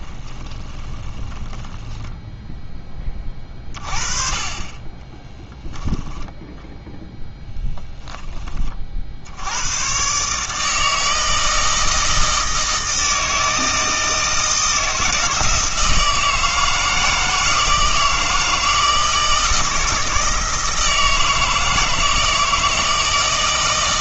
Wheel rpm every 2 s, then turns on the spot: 20, 10, 20, 0, 30, 160, 160, 160, 160, 160, 160, 160.
0-2